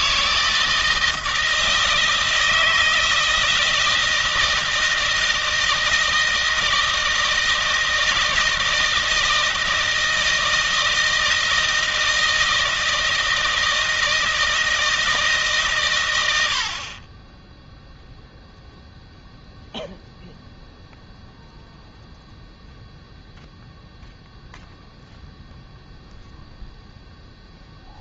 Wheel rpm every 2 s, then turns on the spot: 160, 160, 160, 160, 160, 160, 160, 160, 80, 0, 0, 0, 0, 0.
none